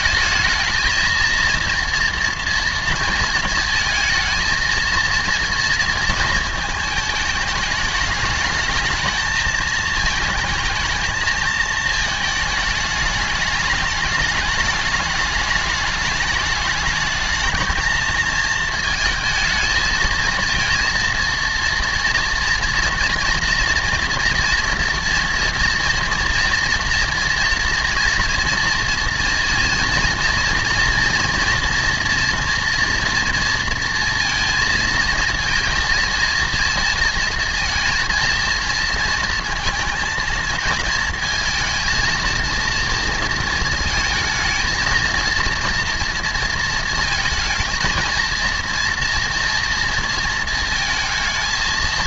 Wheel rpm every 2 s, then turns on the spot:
220, 230, 230, 230, 220, 220, 220, 210, 210, 220, 220, 230, 230, 230, 230, 230, 230, 230, 230, 230, 230, 230, 220, 230, 230, 230.
none